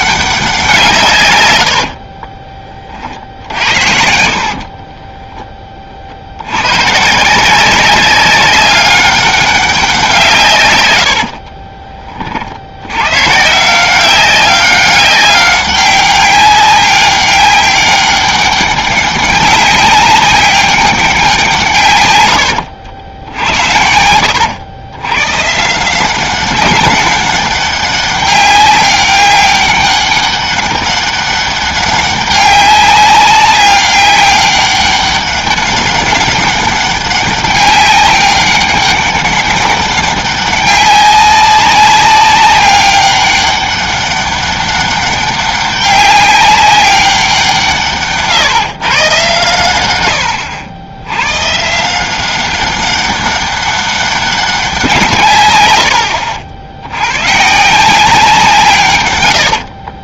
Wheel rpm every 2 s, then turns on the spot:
170, 30, 40, 110, 200, 120, 80, 190, 200, 200, 200, 80, 100, 200, 200, 200, 200, 200, 200, 200, 200, 200, 200, 200, 140, 90, 200, 180, 70, 150.
4-6